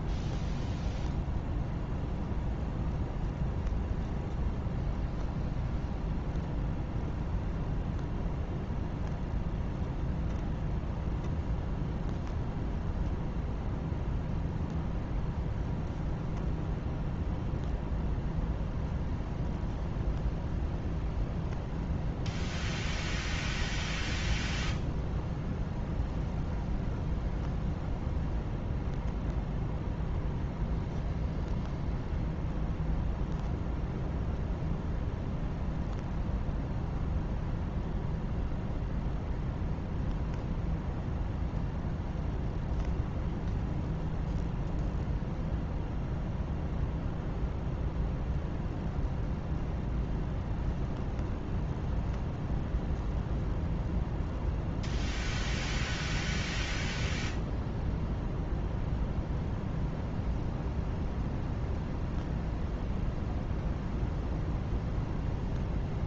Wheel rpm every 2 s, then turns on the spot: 0, 0, 0, 0, 0, 0, 0, 0, 0, 0, 0, 0, 0, 0, 0, 0, 0, 0, 0, 0, 0, 0, 0, 0, 0, 0, 0, 0, 0, 0, 0, 0, 0.
none